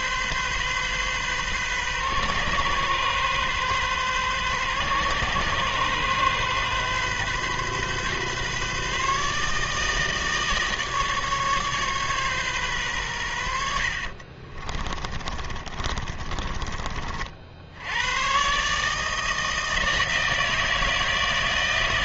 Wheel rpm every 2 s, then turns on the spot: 130, 130, 130, 130, 150, 150, 110, 30, 40, 160, 160.
14-16